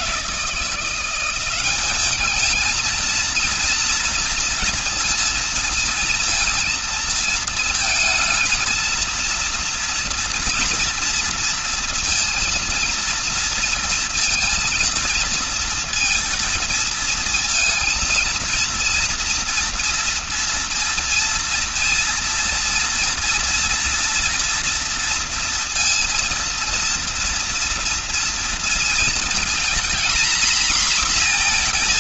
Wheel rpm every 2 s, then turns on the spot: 180, 230, 230, 230, 230, 230, 230, 230, 230, 230, 230, 230, 230, 230, 230, 240.
none